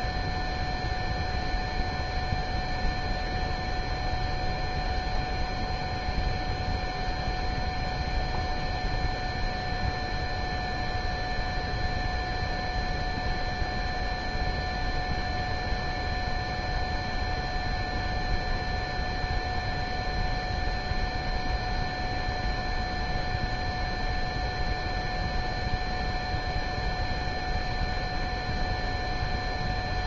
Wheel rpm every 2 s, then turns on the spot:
0, 0, 0, 0, 0, 0, 0, 0, 0, 0, 0, 0, 0, 0, 0.
none